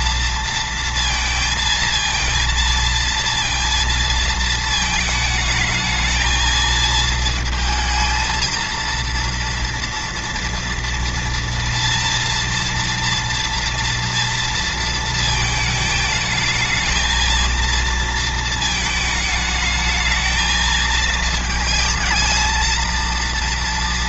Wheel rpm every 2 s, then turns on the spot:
230, 230, 220, 220, 230, 230, 230, 230, 220, 220, 220, 230.
none